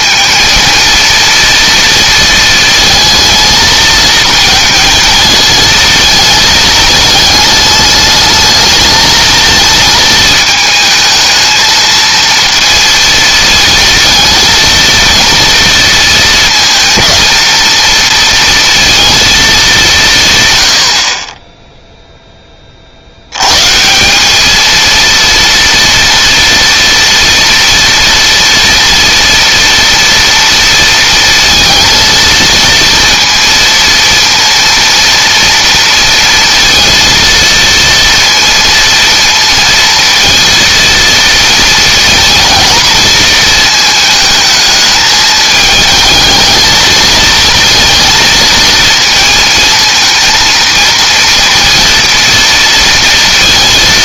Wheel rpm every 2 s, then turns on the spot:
230, 230, 230, 220, 220, 220, 230, 230, 230, 230, 120, 20, 220, 230, 230, 230, 230, 230, 230, 230, 230, 220, 220, 220, 230, 230, 230.
none